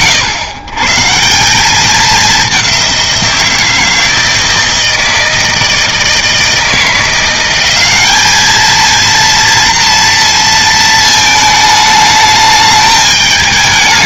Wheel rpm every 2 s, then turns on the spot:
130, 190, 160, 170, 230, 220, 210.
none